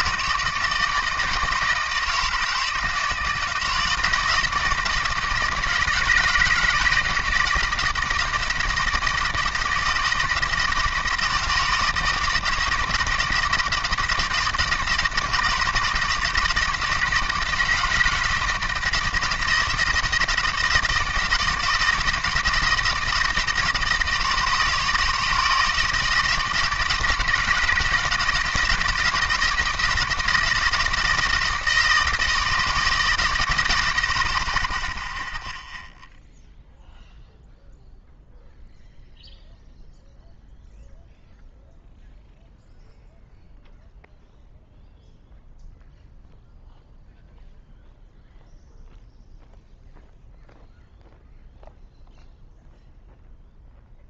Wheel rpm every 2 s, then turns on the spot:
160, 160, 160, 160, 160, 160, 160, 160, 160, 160, 160, 160, 160, 170, 160, 160, 160, 20, 0, 0, 0, 0, 0, 0, 0, 0, 0.
none